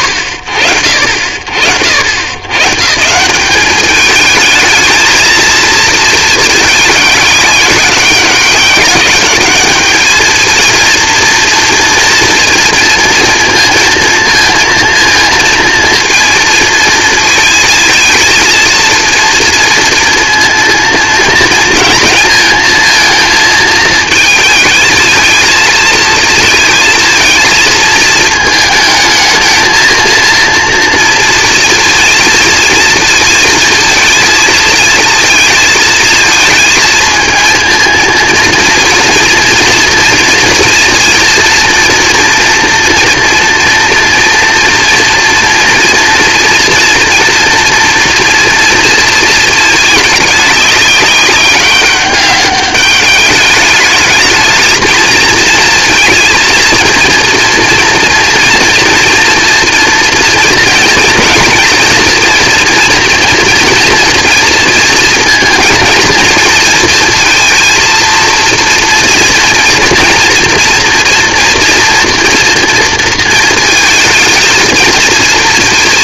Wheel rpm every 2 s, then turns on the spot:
50, 170, 220, 220, 200, 230, 240, 230, 230, 230, 230, 230, 220, 220, 220, 230, 230, 220, 220, 230, 230, 230, 230, 230, 230, 200, 200, 220, 230, 230, 230, 230, 230, 230, 230, 230, 230, 220.
none